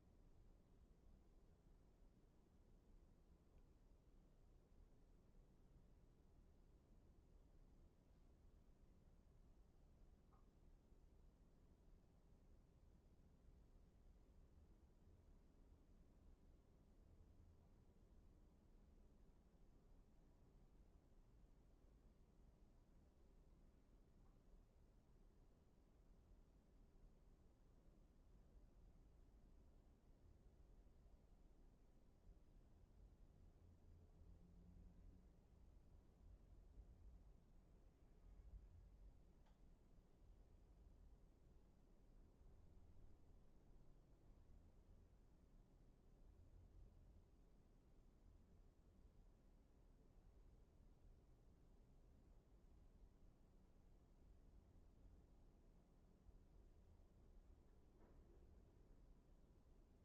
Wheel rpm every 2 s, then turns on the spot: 0, 0, 0, 0, 0, 0, 0, 0, 0, 0, 0, 0, 0, 0, 0, 0, 0, 0, 0, 0, 0, 0, 0, 0, 0, 0, 0, 0, 0, 0.
none